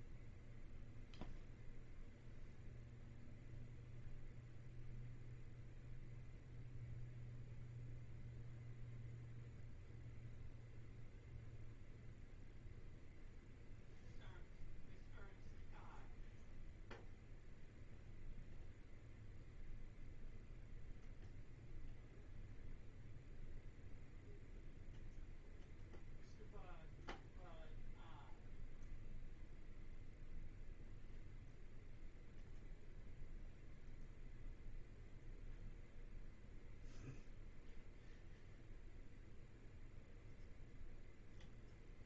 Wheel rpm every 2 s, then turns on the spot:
0, 0, 0, 0, 0, 0, 0, 0, 0, 0, 0, 0, 0, 0, 0, 0, 0, 0, 0, 0, 0.
none